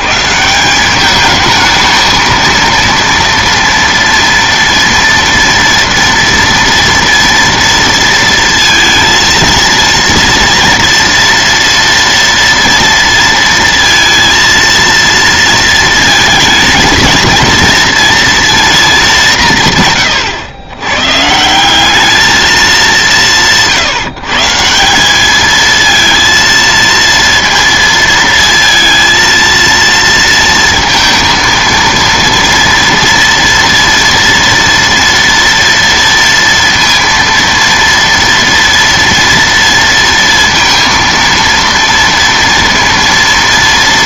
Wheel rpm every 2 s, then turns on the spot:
170, 230, 240, 230, 230, 230, 230, 230, 220, 230, 110, 210, 170, 230, 230, 230, 230, 230, 230, 230, 230, 230.
none